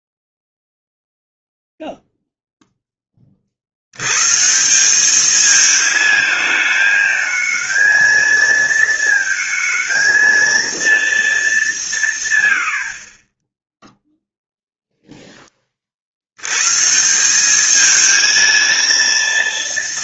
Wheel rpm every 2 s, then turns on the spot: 0, 0, 150, 220, 230, 230, 190, 0, 110, 230.
none